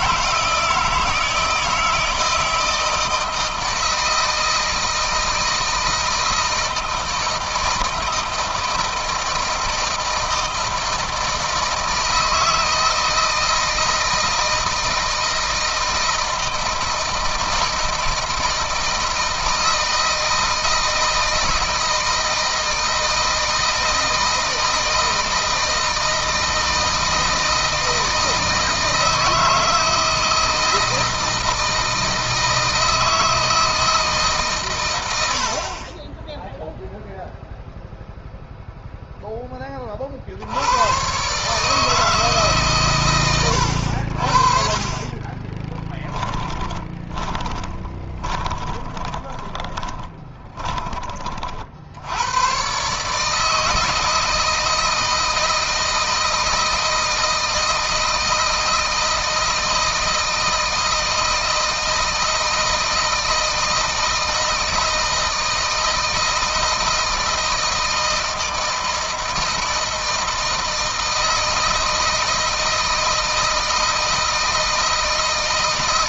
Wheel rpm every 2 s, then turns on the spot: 160, 160, 160, 160, 160, 160, 160, 160, 160, 160, 160, 160, 160, 160, 160, 160, 160, 120, 0, 0, 80, 140, 40, 20, 20, 20, 120, 160, 160, 160, 160, 160, 160, 160, 160, 160, 160, 160.
46-52